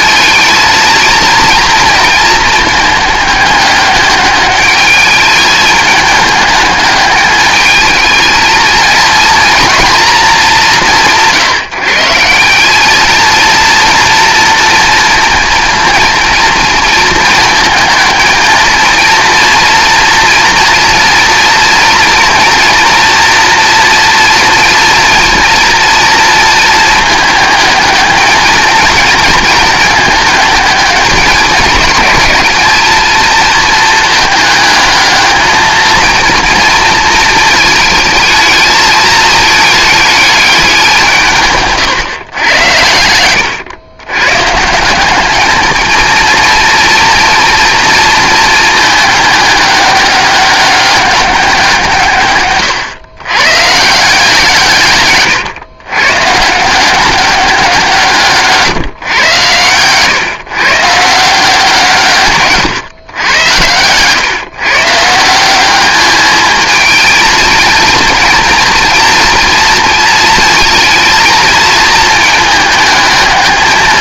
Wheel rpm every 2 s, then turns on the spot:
230, 220, 210, 210, 230, 200, 190, 230, 230, 230, 230, 230, 230, 230, 220, 220, 210, 220, 230, 220, 200, 110, 160, 230, 220, 200, 120, 150, 160, 150, 130, 130, 140, 220, 230, 230, 220.
52-54 58-60